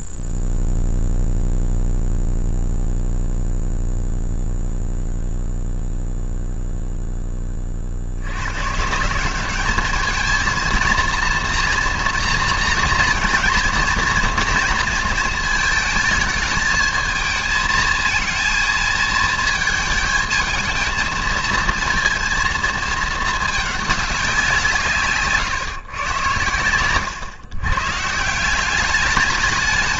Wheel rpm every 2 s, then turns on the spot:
0, 0, 0, 0, 60, 210, 230, 240, 220, 220, 220, 230, 190, 120, 160.
none